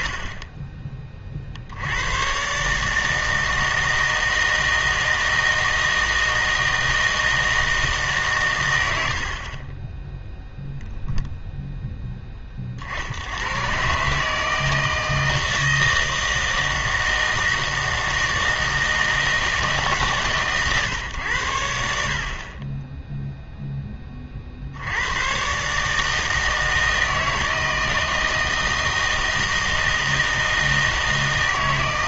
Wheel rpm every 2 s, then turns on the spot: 20, 140, 160, 160, 100, 0, 40, 160, 160, 160, 130, 20, 60, 160, 160, 160.
none